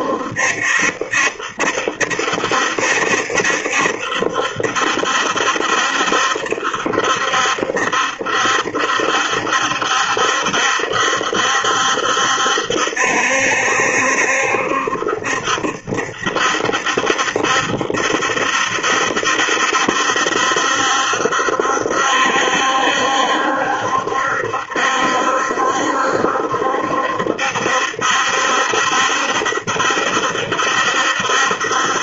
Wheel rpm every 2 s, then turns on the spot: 70, 70, 70, 70, 70, 70, 70, 70, 70, 70, 70, 70, 70, 70, 70, 70.
none